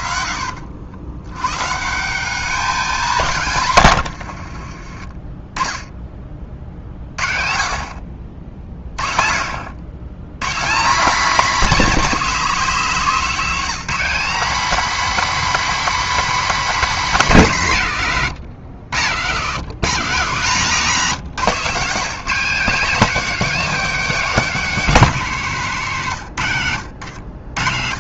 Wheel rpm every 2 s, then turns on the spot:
60, 200, 40, 40, 40, 180, 230, 260, 260, 100, 150, 220, 240, 110.
4-6